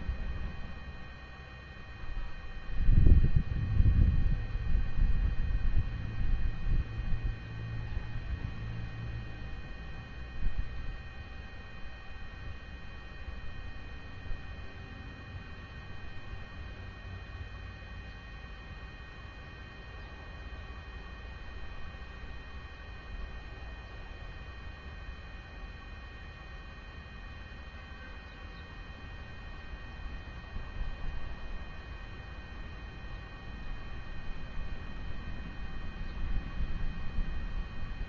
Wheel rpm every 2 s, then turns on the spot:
0, 0, 0, 0, 0, 0, 0, 0, 0, 0, 0, 0, 0, 0, 0, 0, 0, 0, 0.
none